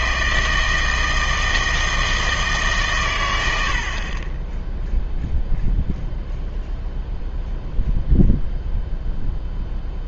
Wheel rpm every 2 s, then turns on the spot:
160, 130, 0, 0, 0.
none